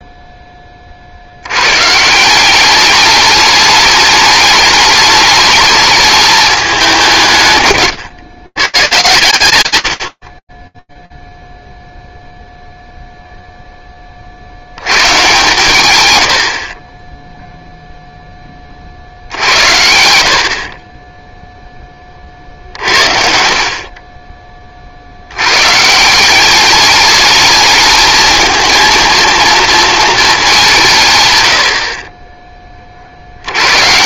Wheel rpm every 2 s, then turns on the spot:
30, 200, 210, 190, 120, 10, 0, 80, 40, 50, 20, 70, 90, 210, 230, 110, 70.
none